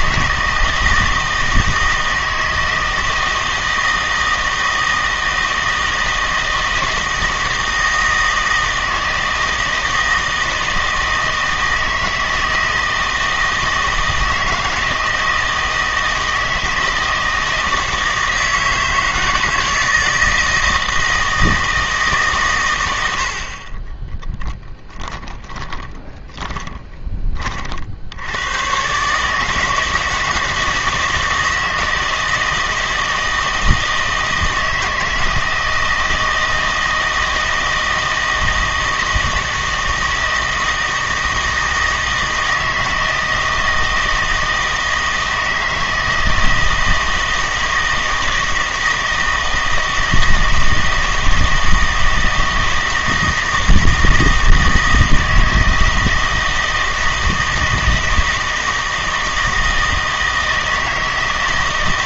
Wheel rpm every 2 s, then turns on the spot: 160, 160, 160, 160, 160, 160, 160, 160, 160, 160, 160, 110, 10, 20, 110, 160, 160, 160, 160, 160, 160, 160, 160, 160, 160, 160, 160, 160, 160, 160, 160.
24-28